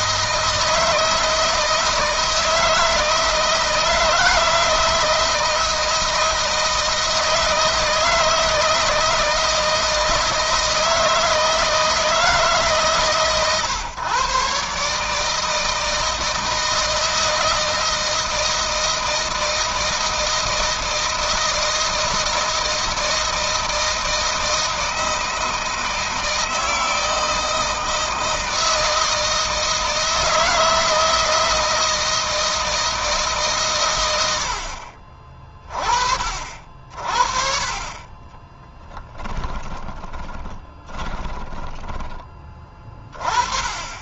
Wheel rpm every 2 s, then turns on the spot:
160, 160, 160, 160, 160, 160, 140, 150, 160, 160, 160, 160, 160, 160, 160, 160, 160, 50, 40, 10, 30, 20.
38-42